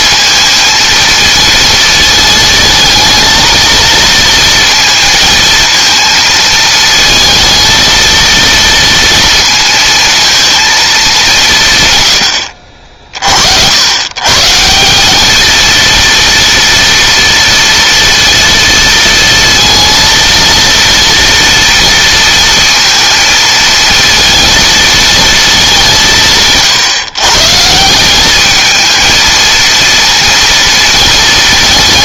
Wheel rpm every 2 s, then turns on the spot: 230, 220, 230, 220, 230, 210, 50, 170, 240, 230, 230, 230, 230, 140, 220, 230.
none